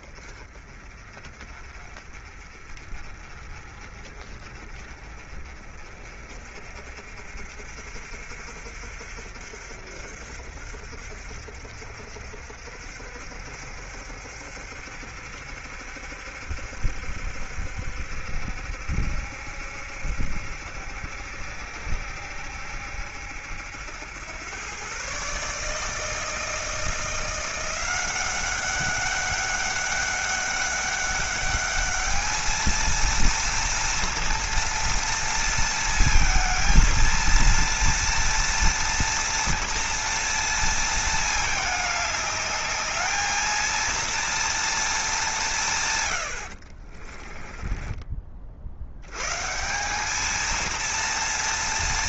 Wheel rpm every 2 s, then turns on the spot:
40, 40, 40, 50, 60, 60, 60, 70, 60, 70, 70, 70, 120, 170, 200, 200, 230, 230, 230, 230, 230, 210, 220, 40, 80, 230.
46-48